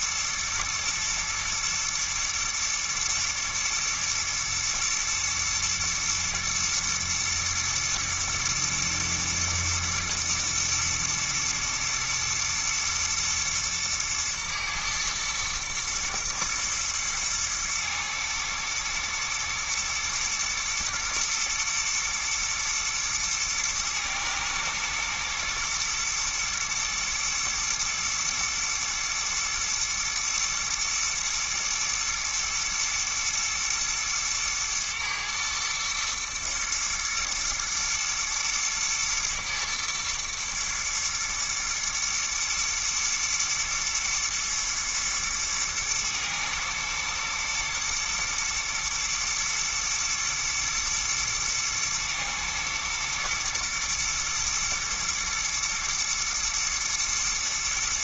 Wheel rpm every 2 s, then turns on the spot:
120, 110, 120, 120, 120, 120, 120, 120, 120, 110, 110, 110, 110, 120, 110, 110, 110, 110, 120, 110, 110, 110, 110, 120, 110, 120, 110, 120, 120.
none